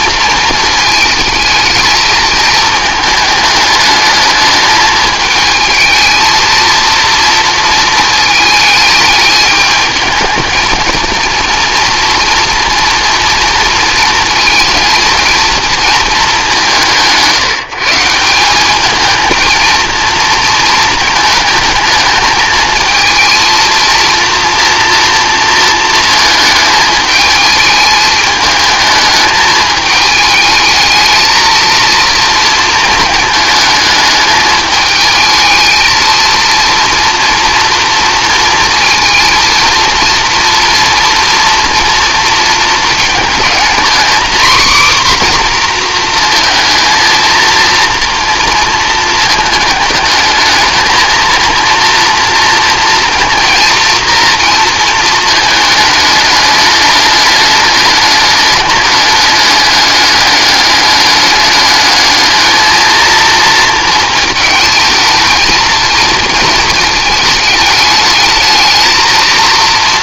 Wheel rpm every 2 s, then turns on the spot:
220, 220, 210, 230, 220, 220, 240, 230, 170, 200, 220, 220, 230, 220, 220, 220, 230, 210, 230, 230, 230, 220, 260, 230, 230, 220, 230, 230, 210, 210, 200, 230, 220, 220, 220.
none